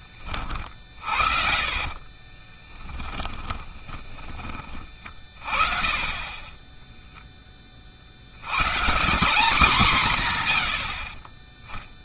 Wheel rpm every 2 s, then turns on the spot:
40, 20, 30, 10, 160, 90.
0-4 6-8